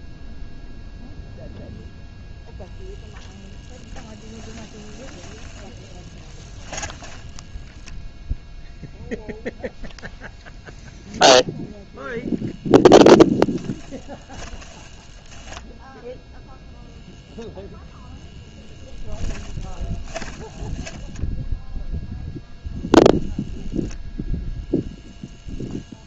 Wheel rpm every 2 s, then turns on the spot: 0, 0, 10, 10, 0, 0, 0, 10, 0, 10, 10, 0, 10.
4-6 18-20 24-26